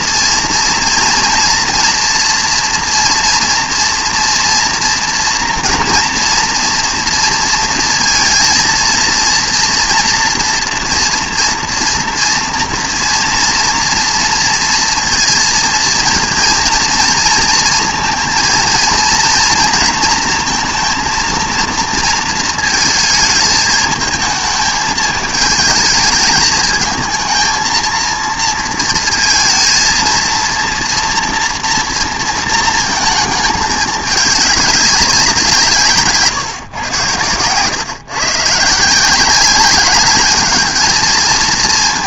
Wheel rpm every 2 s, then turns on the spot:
230, 230, 230, 230, 230, 230, 230, 230, 230, 230, 230, 230, 220, 220, 230, 240, 230, 200, 120, 160, 220.
none